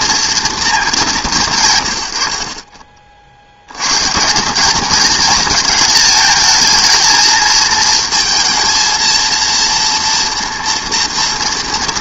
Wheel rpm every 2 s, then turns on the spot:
100, 150, 220, 230, 230, 220.
none